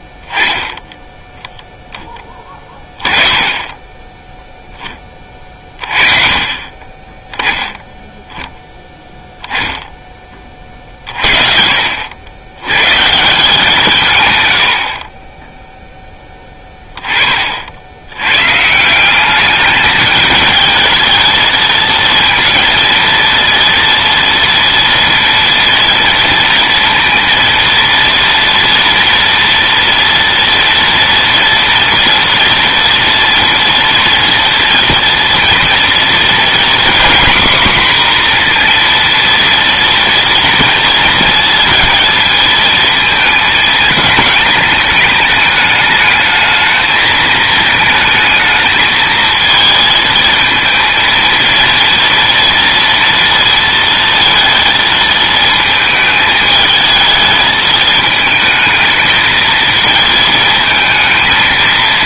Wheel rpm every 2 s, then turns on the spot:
10, 10, 10, 30, 10, 40, 110, 90, 20, 150, 220, 230, 230, 230, 230, 230, 240, 230, 240, 240, 230, 220, 220, 220, 220, 220, 230, 230, 220, 220, 220.
none